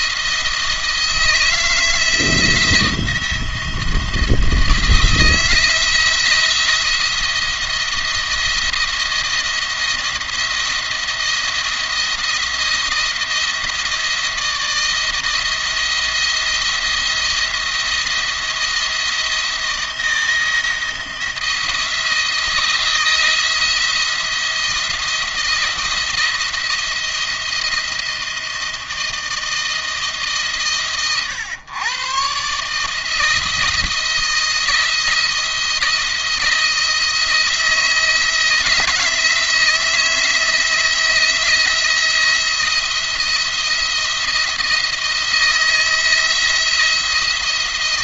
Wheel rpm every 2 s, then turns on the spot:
160, 170, 170, 170, 170, 170, 170, 160, 170, 170, 160, 160, 170, 170, 160, 140, 140, 170, 170, 160, 160, 170, 160, 170.
none